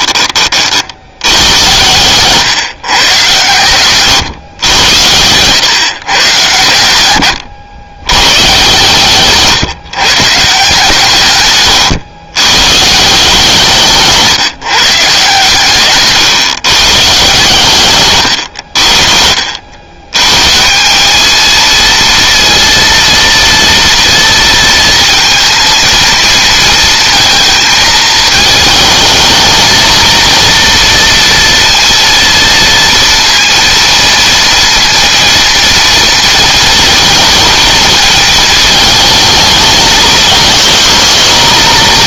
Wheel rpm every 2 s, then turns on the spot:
60, 130, 100, 110, 120, 150, 140, 140, 120, 70, 170, 230, 230, 230, 220, 230, 230, 230, 230, 220, 220.
none